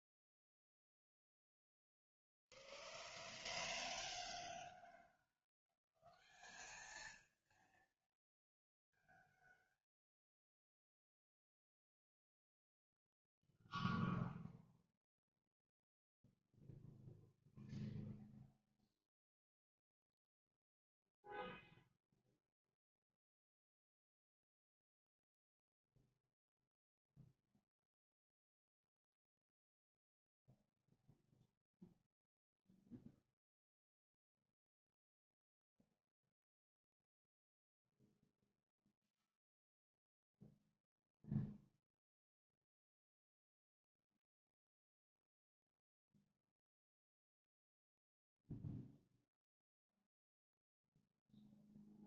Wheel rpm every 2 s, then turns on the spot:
0, 0, 0, 0, 0, 0, 0, 0, 0, 0, 0, 0, 0, 0, 0, 0, 0, 0, 0, 0, 0, 0, 0, 0, 0, 0.
none